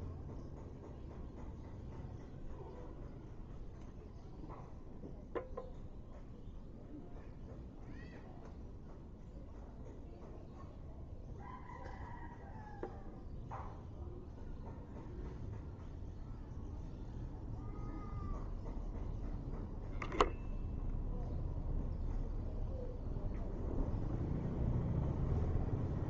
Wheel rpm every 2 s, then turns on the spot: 0, 0, 0, 0, 0, 0, 0, 0, 0, 0, 0, 0, 0.
none